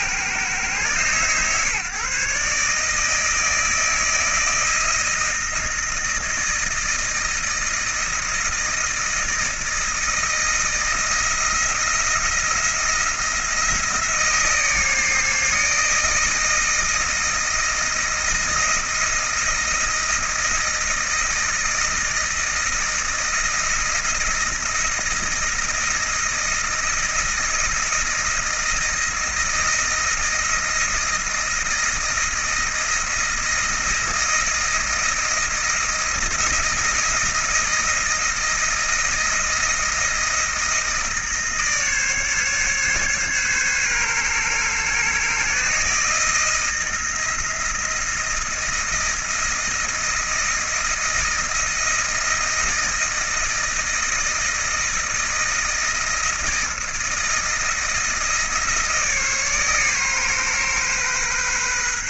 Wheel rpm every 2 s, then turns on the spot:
130, 150, 160, 160, 160, 160, 160, 150, 160, 160, 160, 160, 160, 170, 160, 170, 170, 170, 160, 160, 160, 140, 140, 170, 160, 170, 160, 160, 160, 160, 130.
none